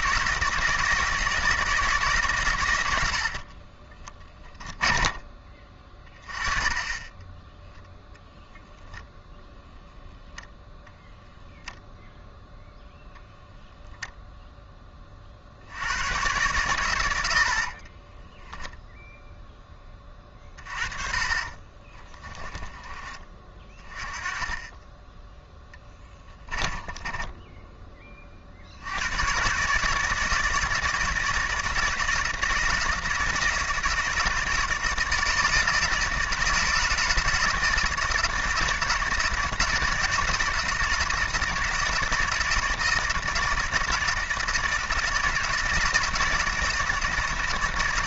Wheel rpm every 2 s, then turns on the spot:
160, 90, 20, 20, 0, 0, 0, 20, 90, 0, 30, 20, 20, 10, 90, 160, 160, 160, 160, 160, 160, 160, 160, 160.
4-6 20-22 26-28